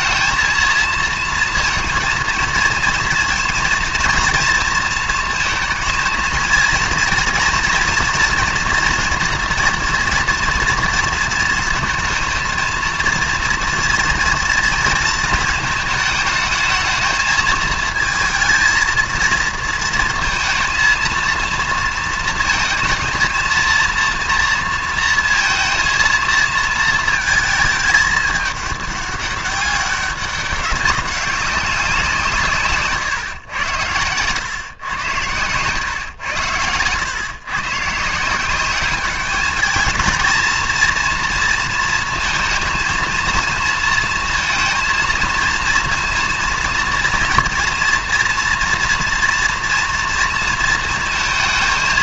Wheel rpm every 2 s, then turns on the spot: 230, 230, 230, 230, 240, 230, 230, 230, 220, 230, 230, 230, 230, 220, 200, 200, 140, 110, 110, 190, 230, 230, 230, 230, 240, 230.
32-34